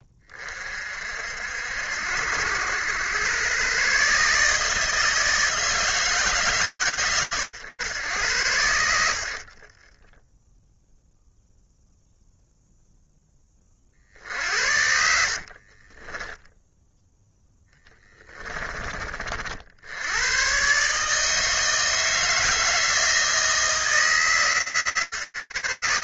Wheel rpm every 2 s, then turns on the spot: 30, 80, 150, 120, 100, 10, 0, 80, 10, 20, 140, 160, 130.
14-16